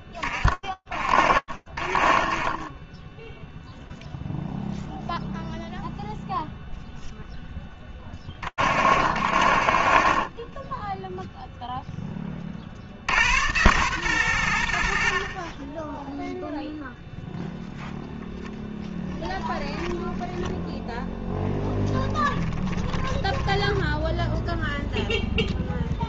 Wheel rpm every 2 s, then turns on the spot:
30, 0, 0, 30, 50, 0, 110, 30, 0, 20, 10, 10, 0.
18-24